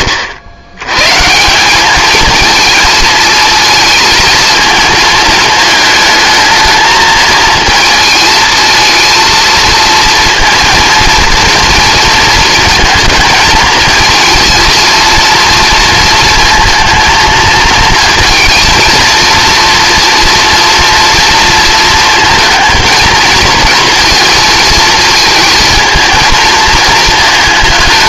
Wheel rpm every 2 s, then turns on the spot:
110, 220, 220, 220, 220, 230, 230, 230, 230, 230, 230, 230, 230, 220.
none